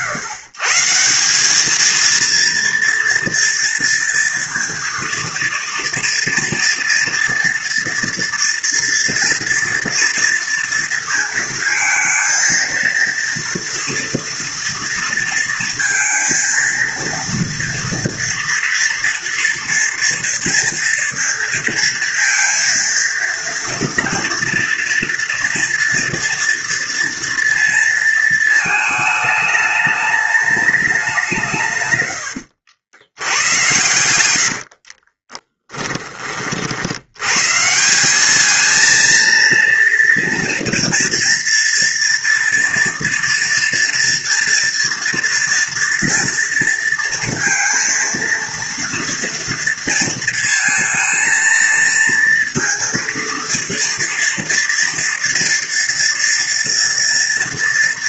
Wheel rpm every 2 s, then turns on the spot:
140, 230, 230, 230, 230, 230, 230, 230, 230, 230, 230, 230, 230, 230, 220, 210, 80, 60, 50, 220, 230, 230, 230, 230, 230, 230, 230, 230, 230.
34-36